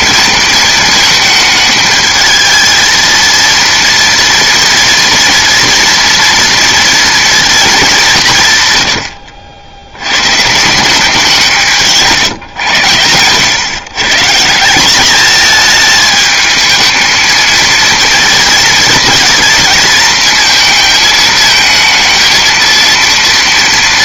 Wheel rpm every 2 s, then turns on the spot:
220, 220, 230, 230, 150, 160, 120, 180, 220, 230, 220, 230.
none